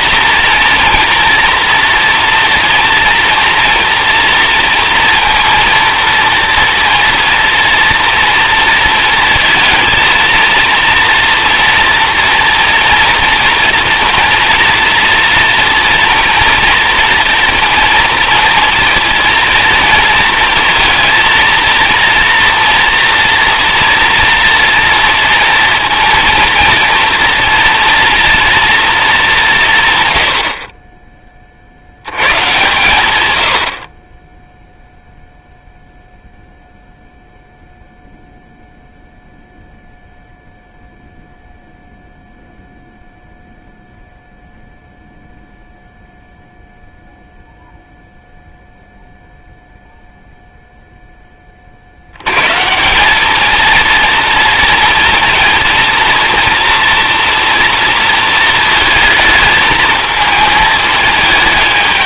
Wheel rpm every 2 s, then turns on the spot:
230, 230, 230, 230, 230, 230, 230, 240, 240, 230, 230, 240, 230, 230, 230, 30, 140, 0, 0, 0, 0, 0, 0, 0, 0, 0, 120, 230, 230, 230, 220.
none